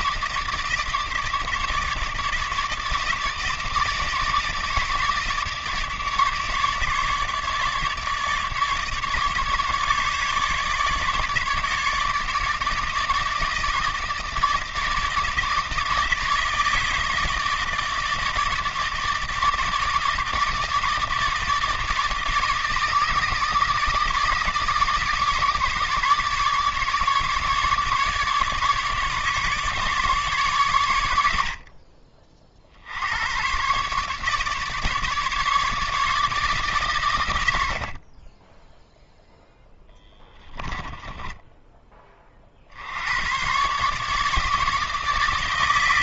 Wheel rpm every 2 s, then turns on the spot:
150, 150, 150, 150, 150, 150, 160, 160, 150, 160, 160, 160, 160, 150, 150, 110, 70, 150, 140, 10, 10, 80, 160.
40-42